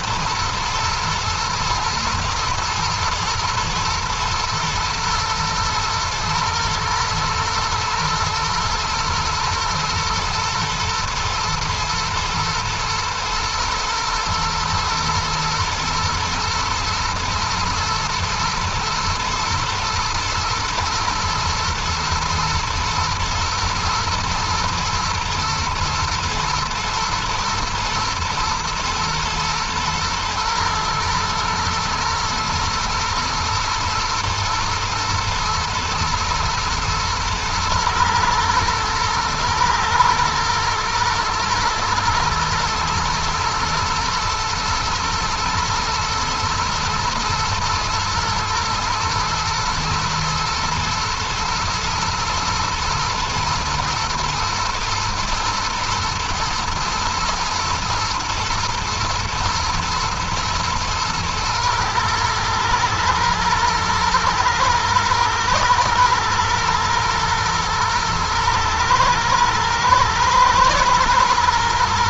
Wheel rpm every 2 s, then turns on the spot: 110, 110, 120, 110, 110, 110, 110, 110, 120, 110, 110, 110, 110, 110, 110, 110, 110, 110, 110, 110, 110, 110, 110, 110, 110, 120, 120, 120, 120, 110, 110, 110, 120, 110, 110, 120.
none